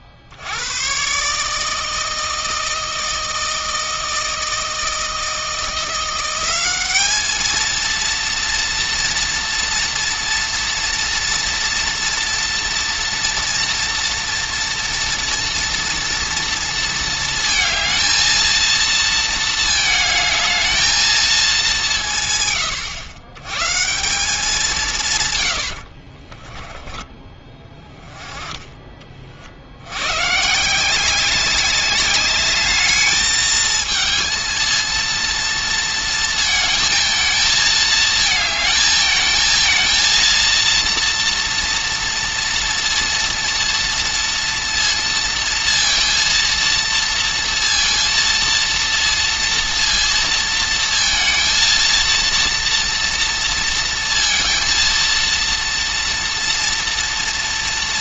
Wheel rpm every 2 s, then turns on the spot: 90, 160, 160, 190, 230, 230, 230, 230, 230, 230, 220, 130, 180, 10, 30, 180, 210, 230, 220, 220, 230, 230, 230, 230, 230, 230, 230, 230, 230.
none